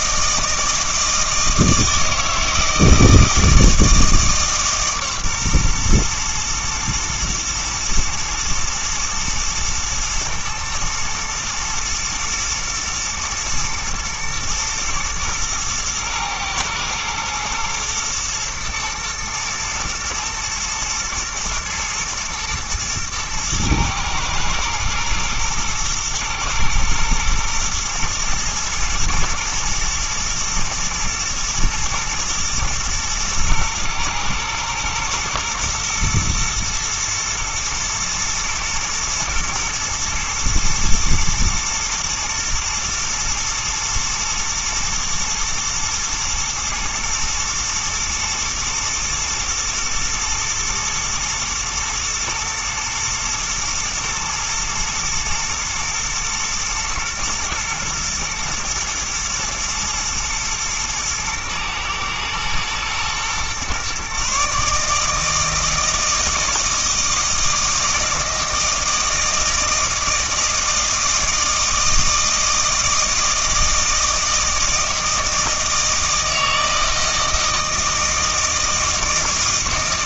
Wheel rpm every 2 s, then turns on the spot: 160, 160, 150, 120, 110, 110, 110, 110, 110, 110, 120, 110, 110, 120, 110, 120, 110, 110, 120, 120, 110, 120, 120, 110, 110, 120, 120, 110, 120, 120, 120, 110, 150, 160, 160, 160, 160, 160, 160, 160.
none